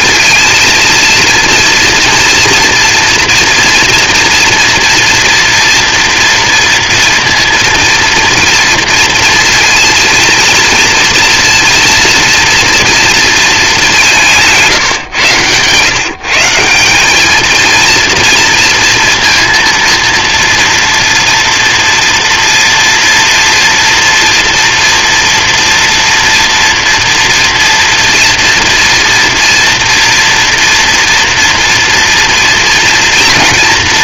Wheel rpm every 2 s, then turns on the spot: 230, 230, 240, 230, 230, 230, 230, 160, 180, 230, 230, 230, 230, 240, 240, 240, 230.
none